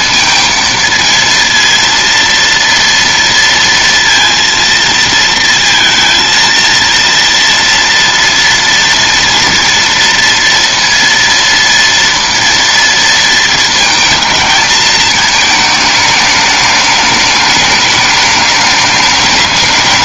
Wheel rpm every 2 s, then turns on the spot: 230, 230, 230, 230, 230, 230, 230, 220, 210, 210.
none